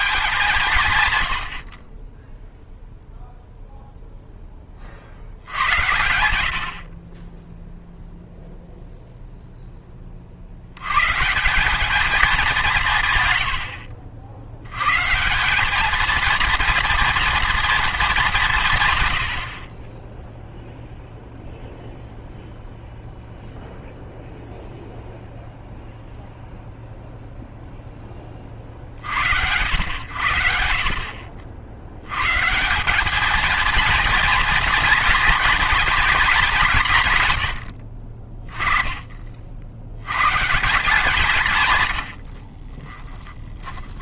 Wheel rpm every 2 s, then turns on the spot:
160, 0, 10, 80, 0, 60, 200, 80, 230, 180, 0, 0, 0, 0, 40, 70, 150, 230, 210, 30, 150, 40.
42-44